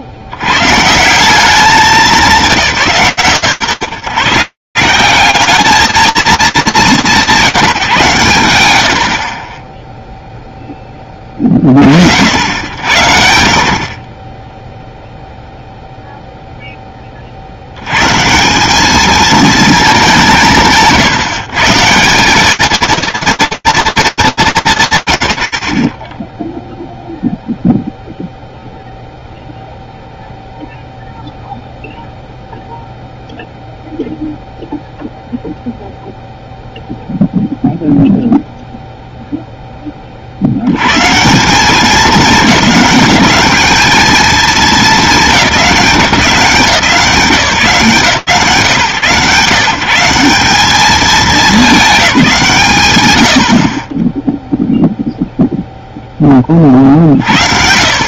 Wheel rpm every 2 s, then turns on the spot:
100, 140, 200, 150, 0, 70, 30, 0, 80, 210, 160, 80, 0, 0, 0, 0, 0, 0, 0, 70, 210, 220, 170, 120, 190, 140, 0, 10, 30.
none